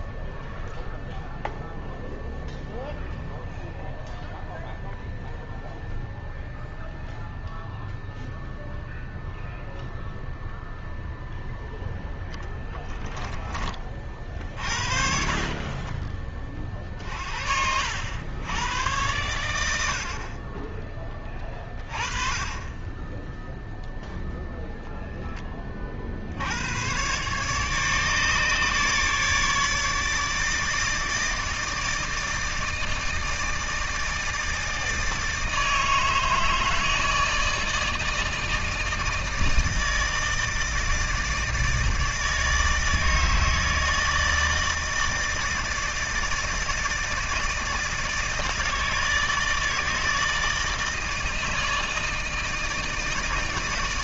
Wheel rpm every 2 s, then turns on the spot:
0, 0, 0, 0, 0, 0, 10, 40, 30, 100, 20, 20, 0, 80, 150, 150, 160, 160, 160, 160, 160, 160, 160, 160, 160, 160, 160.
12-16